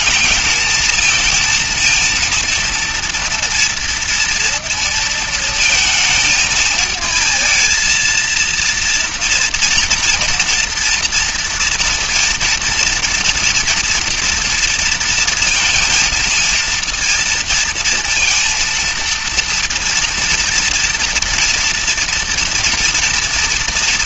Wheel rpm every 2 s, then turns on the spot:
220, 230, 230, 220, 230, 230, 230, 230, 230, 230, 230, 230.
none